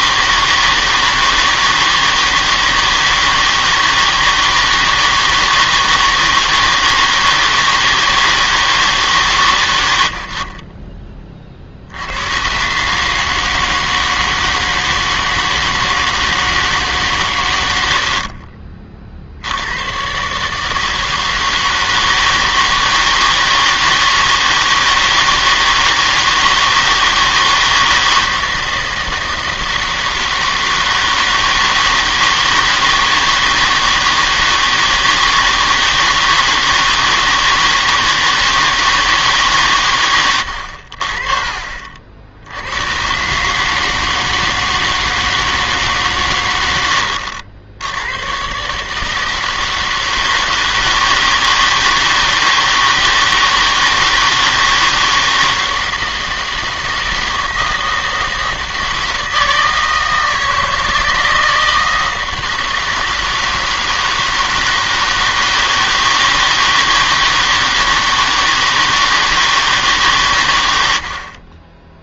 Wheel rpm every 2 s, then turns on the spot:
160, 160, 160, 160, 160, 40, 130, 160, 160, 50, 150, 160, 160, 160, 160, 160, 160, 160, 160, 160, 90, 90, 160, 100, 150, 160, 160, 160, 160, 160, 160, 160, 160, 160, 160, 100.
18-20